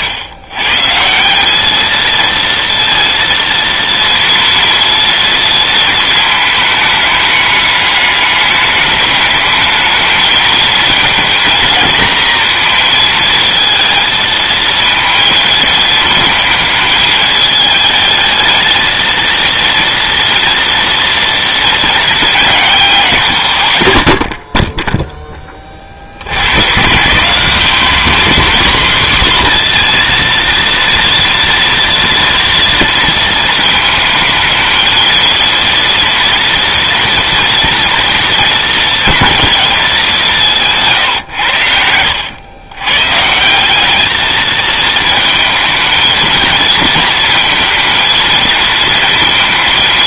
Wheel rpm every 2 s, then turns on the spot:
140, 230, 230, 220, 200, 230, 230, 220, 220, 220, 230, 200, 20, 140, 240, 230, 230, 220, 230, 220, 170, 110, 220, 230, 230.
none